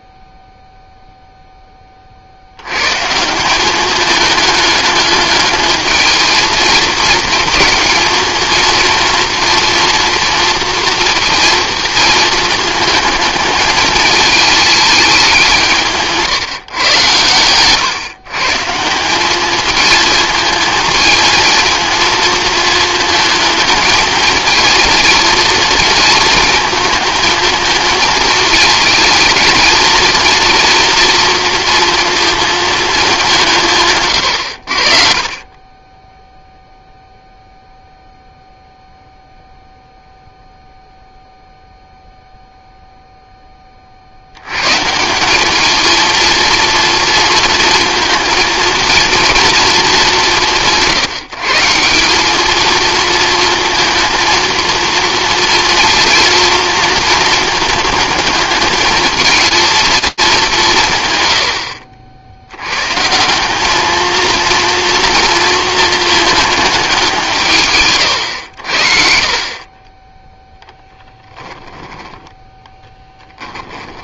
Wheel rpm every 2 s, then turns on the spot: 0, 110, 210, 220, 230, 230, 220, 220, 140, 150, 220, 230, 230, 220, 230, 230, 220, 70, 0, 0, 0, 0, 140, 230, 220, 140, 210, 230, 230, 210, 150, 100, 240, 220, 80, 0, 10.
72-74